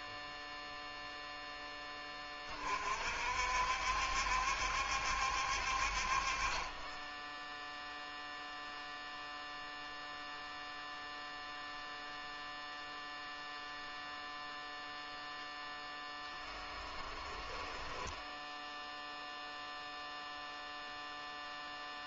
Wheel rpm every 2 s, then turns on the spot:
0, 40, 60, 20, 0, 0, 0, 0, 10, 0, 0.
16-18